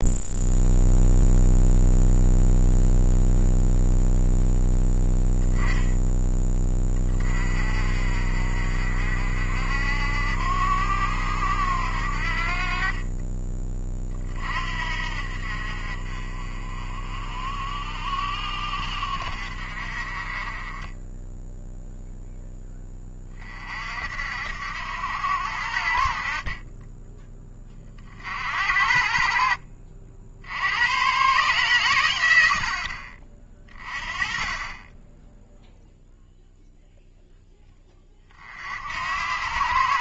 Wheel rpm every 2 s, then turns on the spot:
0, 0, 0, 30, 50, 80, 30, 60, 40, 60, 20, 20, 80, 20, 60, 110, 60, 20, 0, 70.
none